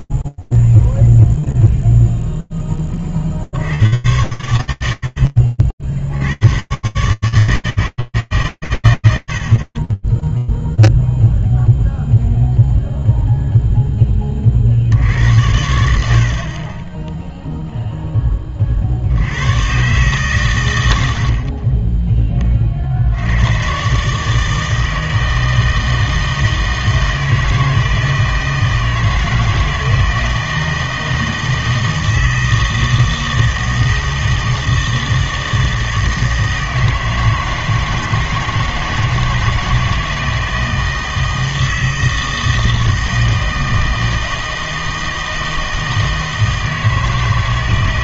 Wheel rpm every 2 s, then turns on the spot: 0, 0, 80, 40, 150, 10, 0, 40, 40, 30, 110, 40, 160, 160, 160, 160, 160, 160, 160, 160, 160, 160, 160, 160.
none